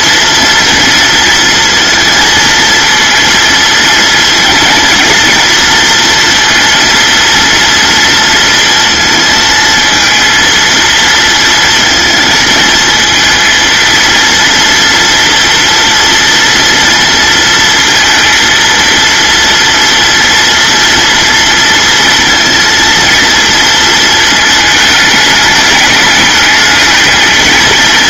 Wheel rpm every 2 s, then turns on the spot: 230, 220, 230, 230, 230, 230, 230, 230, 230, 230, 230, 230, 220, 210.
none